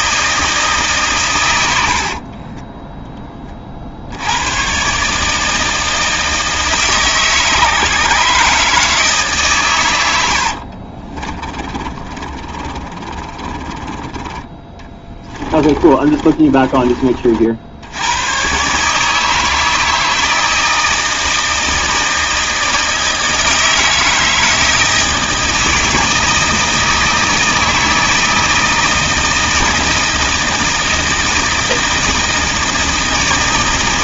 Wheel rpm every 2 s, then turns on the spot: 160, 20, 120, 160, 150, 70, 30, 20, 30, 130, 160, 160, 160, 160, 160, 160, 160.
2-4 10-18